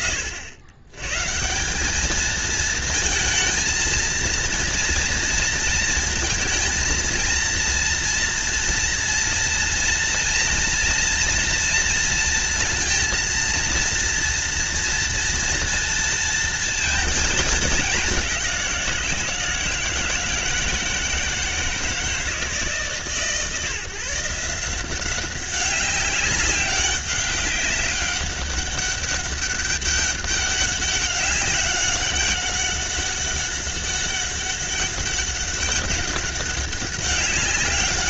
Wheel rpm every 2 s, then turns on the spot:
90, 230, 230, 230, 240, 230, 230, 230, 230, 180, 160, 140, 180, 200, 200, 200, 200, 190, 200.
none